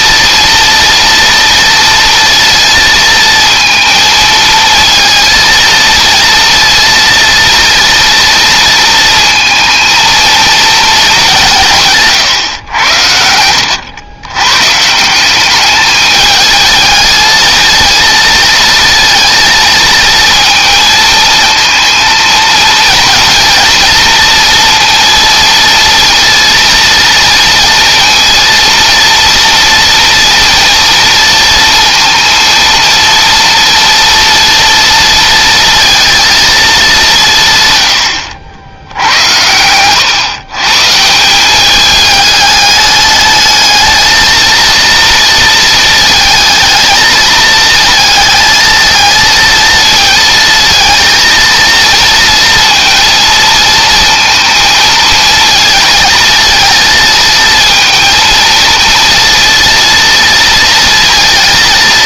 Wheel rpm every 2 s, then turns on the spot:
230, 230, 230, 230, 230, 180, 80, 180, 220, 230, 230, 230, 230, 230, 230, 230, 230, 230, 180, 80, 170, 210, 230, 220, 220, 230, 230, 230, 230, 230, 230.
none